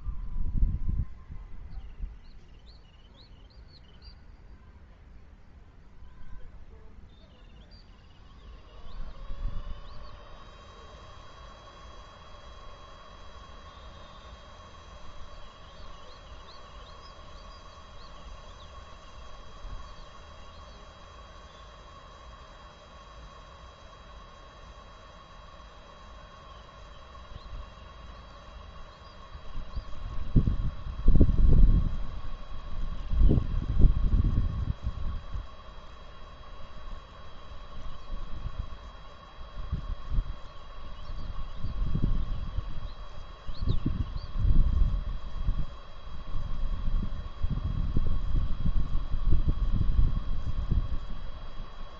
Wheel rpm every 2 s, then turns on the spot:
0, 0, 0, 0, 0, 0, 0, 0, 0, 0, 0, 0, 0, 0, 0, 0, 0, 0, 0, 0, 0, 0, 0, 0, 0, 0.
none